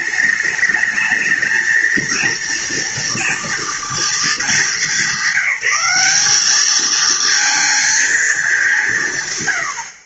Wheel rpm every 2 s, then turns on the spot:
210, 230, 200, 210, 170.
none